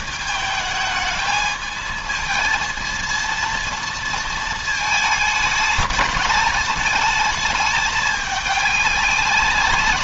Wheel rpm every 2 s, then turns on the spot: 220, 230, 210, 210, 200.
none